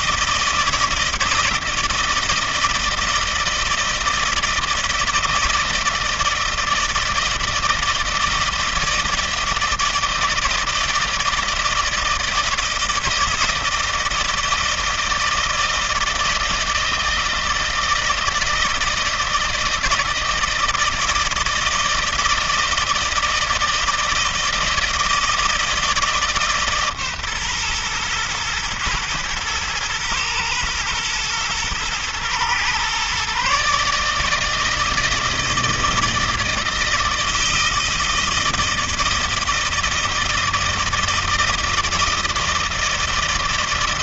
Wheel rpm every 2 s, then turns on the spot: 160, 160, 170, 160, 170, 160, 160, 160, 160, 160, 160, 160, 160, 150, 120, 120, 120, 160, 160, 160, 160, 160.
none